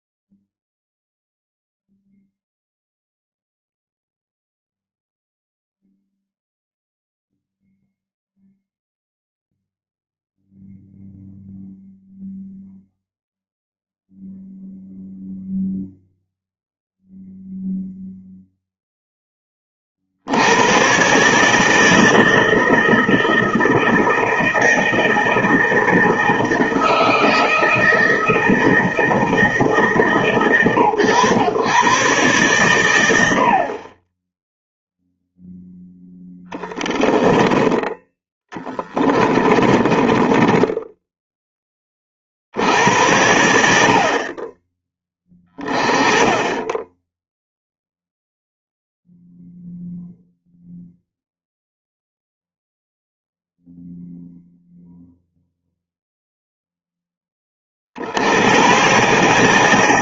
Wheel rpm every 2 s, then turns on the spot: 0, 0, 0, 0, 0, 0, 0, 0, 0, 0, 110, 160, 160, 160, 160, 120, 100, 0, 20, 10, 10, 80, 20, 10, 0, 0, 0, 0, 10, 120.
36-42